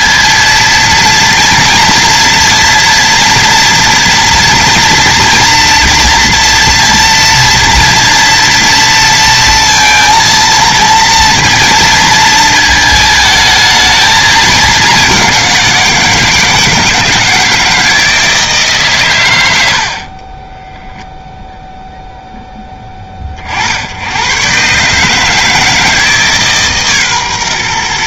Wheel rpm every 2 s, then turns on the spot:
230, 240, 230, 230, 230, 230, 220, 200, 160, 130, 0, 20, 140, 140.
none